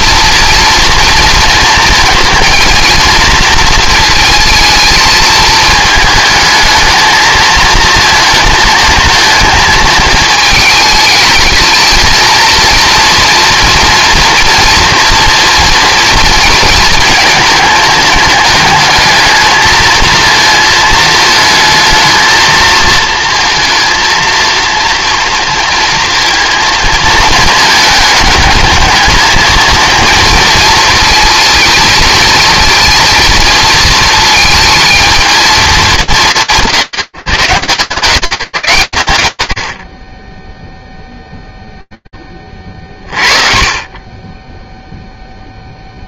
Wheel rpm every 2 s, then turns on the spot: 230, 230, 220, 220, 230, 220, 230, 230, 220, 220, 220, 220, 230, 230, 210, 230, 230, 220, 150, 120, 10, 20, 10.
none